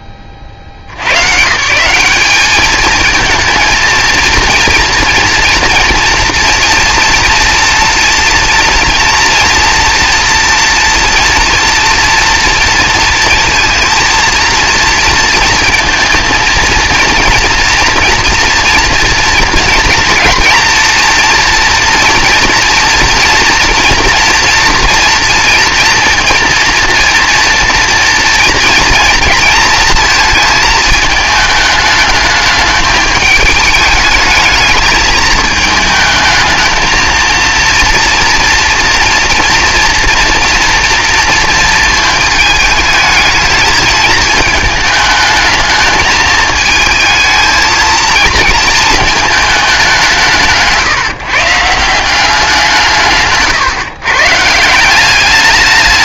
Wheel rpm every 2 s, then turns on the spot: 60, 210, 230, 240, 240, 230, 230, 230, 230, 240, 230, 230, 230, 230, 230, 220, 210, 210, 220, 230, 230, 220, 220, 220, 230, 160, 180, 160.
none